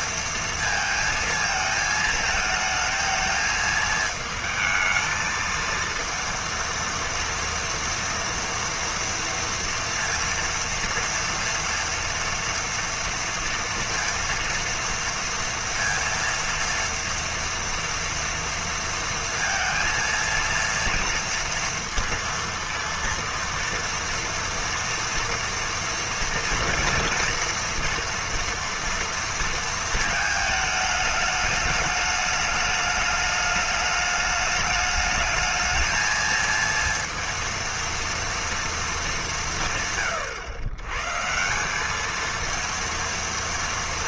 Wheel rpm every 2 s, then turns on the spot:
230, 220, 220, 230, 230, 230, 230, 230, 230, 230, 230, 230, 230, 240, 230, 220, 210, 210, 230, 230, 130, 230.
none